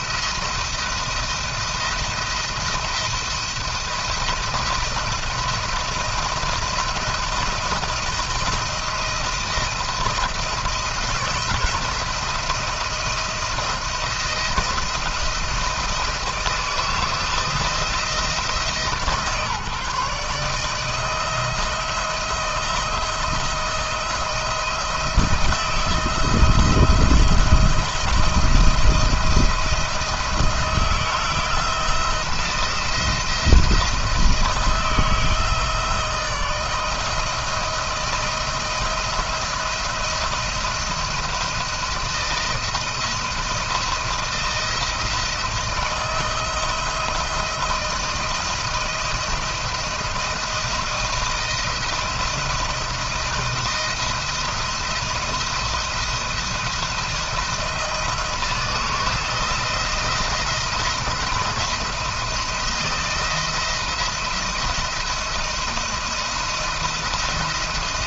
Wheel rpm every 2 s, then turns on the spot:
170, 170, 170, 170, 170, 160, 160, 170, 160, 160, 160, 170, 170, 170, 160, 170, 170, 160, 160, 170, 170, 170, 160, 170, 170, 160, 170, 170, 170, 160, 160, 170, 170, 170.
none